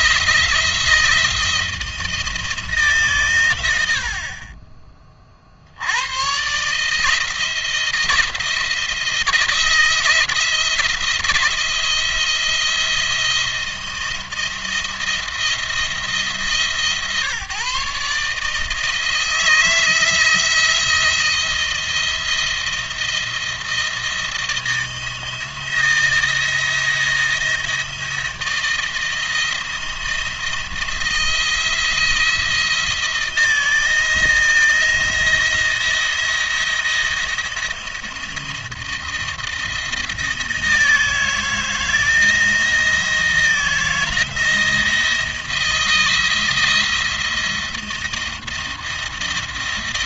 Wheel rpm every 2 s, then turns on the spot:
170, 150, 30, 150, 170, 170, 170, 170, 150, 160, 170, 170, 160, 160, 160, 170, 160, 160, 170, 170, 160, 170, 160, 160, 160.
none